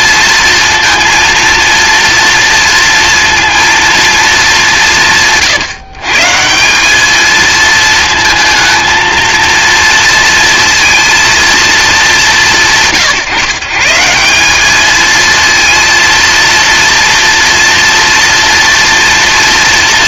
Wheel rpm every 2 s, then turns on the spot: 230, 230, 170, 200, 220, 230, 140, 220, 230, 230.
none